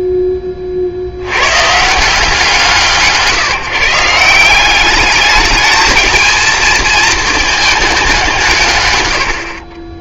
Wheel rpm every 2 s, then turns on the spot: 20, 150, 190, 220, 160.
none